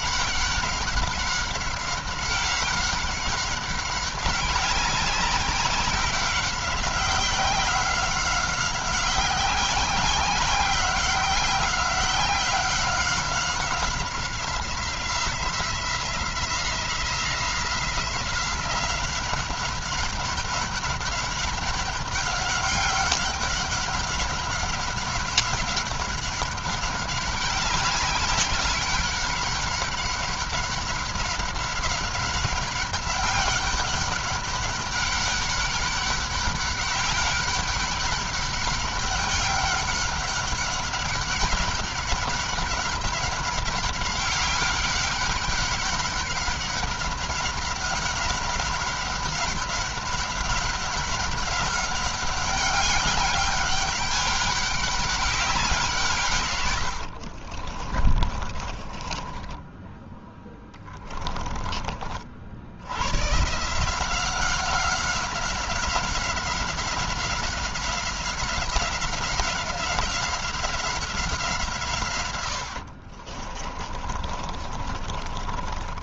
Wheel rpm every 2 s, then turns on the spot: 190, 190, 190, 190, 190, 180, 190, 180, 180, 190, 190, 190, 190, 190, 190, 190, 200, 200, 190, 200, 190, 200, 200, 200, 190, 200, 200, 200, 100, 30, 10, 90, 180, 190, 190, 190, 70, 30.
56-62 72-76